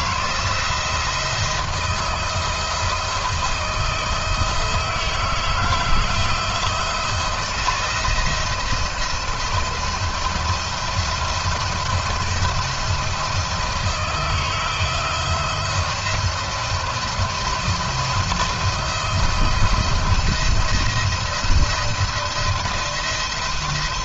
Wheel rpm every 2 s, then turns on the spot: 170, 160, 160, 160, 160, 170, 160, 160, 170, 170, 170, 170.
none